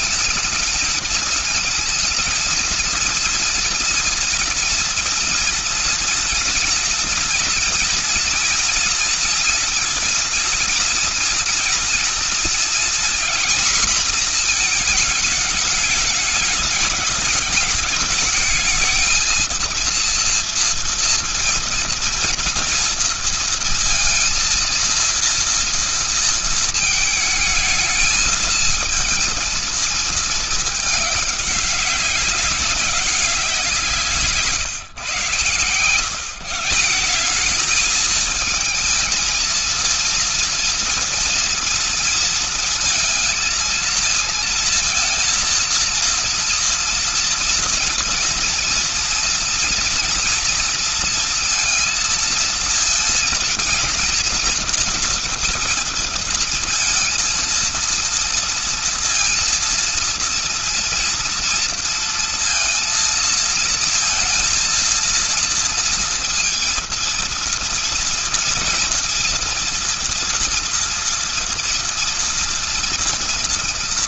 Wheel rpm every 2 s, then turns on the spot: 220, 230, 230, 230, 230, 230, 240, 220, 210, 220, 240, 230, 230, 220, 220, 210, 190, 140, 180, 220, 230, 230, 230, 230, 240, 230, 230, 230, 230, 230, 230, 230, 230, 230, 230, 230, 230.
none